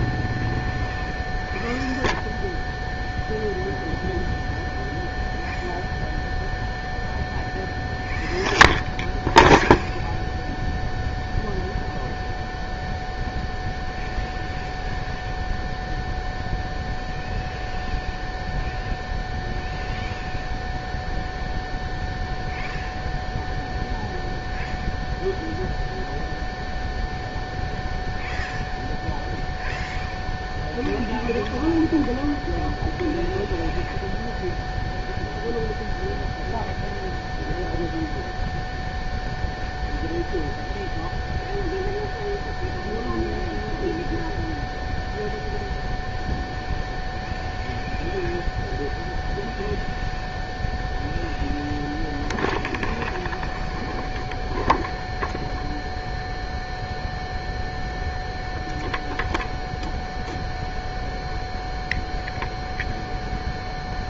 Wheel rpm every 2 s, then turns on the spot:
0, 0, 0, 0, 0, 0, 0, 0, 0, 0, 0, 0, 0, 0, 0, 0, 0, 0, 0, 0, 0, 0, 0, 0, 0, 0, 0, 0, 0, 0, 0, 0.
none